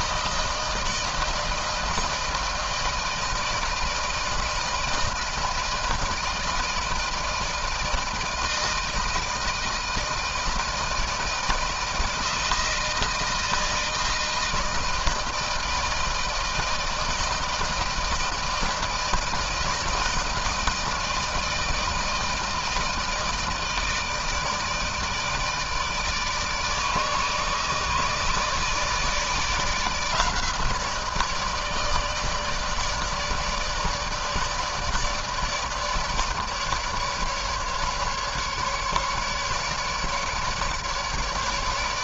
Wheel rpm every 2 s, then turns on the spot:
160, 160, 170, 160, 160, 160, 160, 160, 160, 160, 160, 160, 160, 160, 160, 160, 150, 150, 150, 150, 150.
none